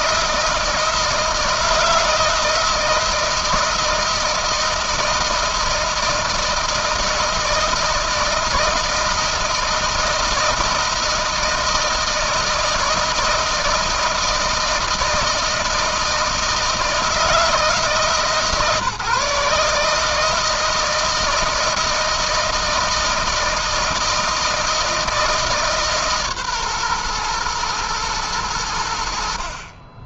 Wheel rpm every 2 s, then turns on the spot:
160, 160, 160, 160, 160, 160, 160, 160, 160, 150, 160, 160, 160, 140, 100.
none